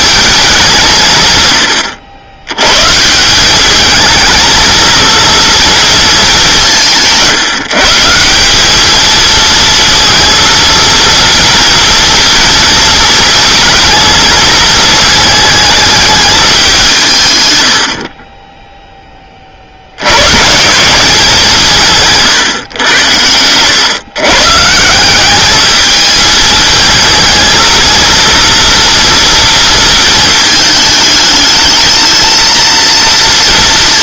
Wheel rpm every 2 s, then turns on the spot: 180, 130, 220, 190, 210, 230, 230, 220, 190, 10, 160, 110, 150, 220, 230, 220, 230.
none